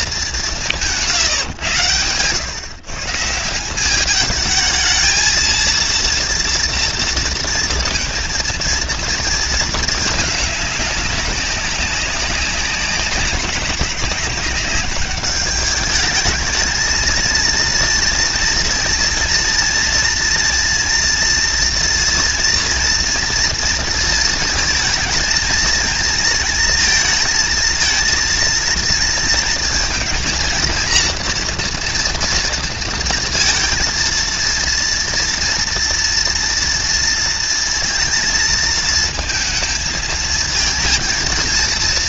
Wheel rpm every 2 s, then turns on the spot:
130, 180, 230, 230, 230, 200, 190, 210, 230, 230, 230, 230, 220, 230, 230, 230, 230, 230, 220, 230, 230.
none